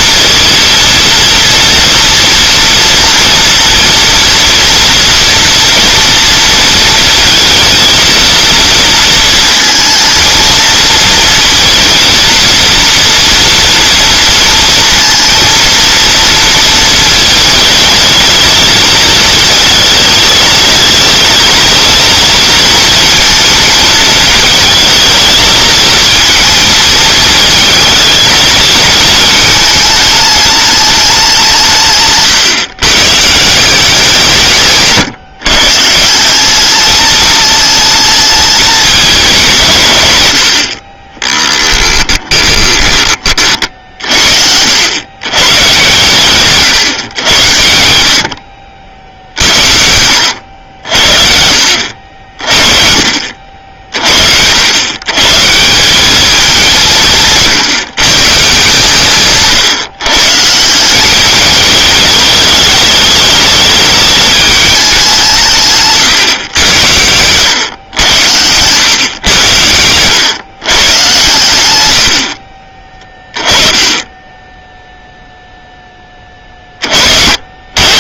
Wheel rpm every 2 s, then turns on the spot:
230, 230, 230, 230, 230, 230, 230, 230, 220, 220, 220, 230, 220, 220, 220, 210, 130, 140, 210, 210, 40, 20, 90, 130, 60, 60, 60, 100, 190, 150, 190, 210, 190, 100, 120, 110, 20, 0, 30.
none